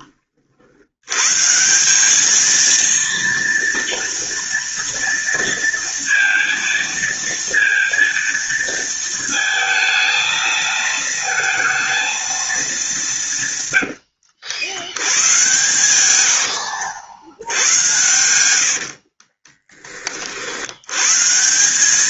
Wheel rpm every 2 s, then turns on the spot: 100, 230, 230, 230, 230, 220, 180, 90, 70, 70, 110.
18-20